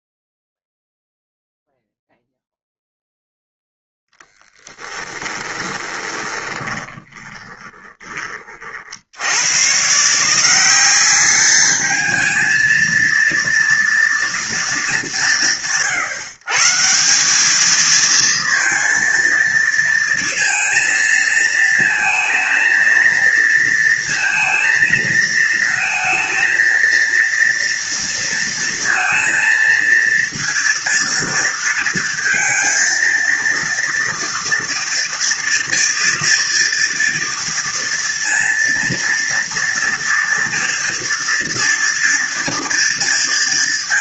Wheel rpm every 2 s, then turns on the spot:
0, 0, 10, 20, 40, 180, 220, 210, 150, 230, 230, 230, 230, 230, 230, 230, 230, 230, 240, 230, 230, 230.
6-8